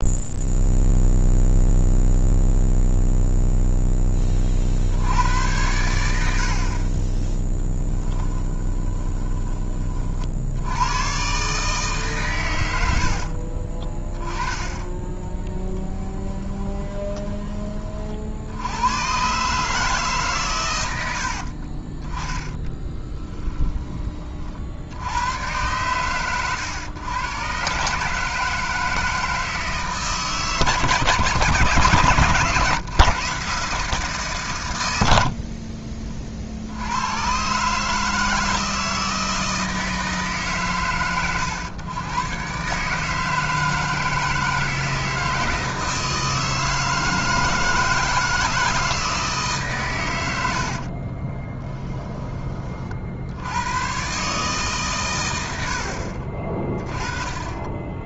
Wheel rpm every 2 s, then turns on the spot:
0, 0, 60, 40, 20, 100, 90, 20, 20, 90, 100, 10, 60, 120, 160, 140, 130, 100, 90, 160, 130, 140, 160, 160, 160, 60, 40, 130, 20.
8-10 12-18 22-24 50-52